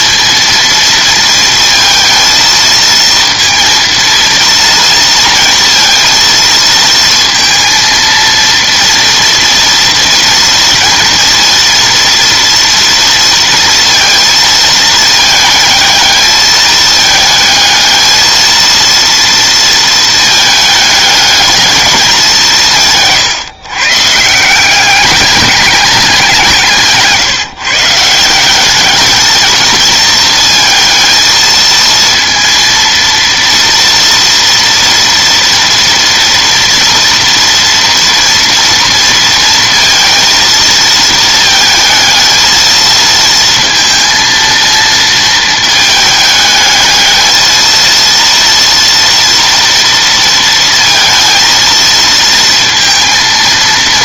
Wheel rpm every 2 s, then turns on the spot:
230, 230, 230, 230, 230, 230, 230, 220, 220, 230, 210, 160, 180, 160, 200, 220, 230, 230, 230, 230, 230, 220, 230, 220, 230, 230, 230.
none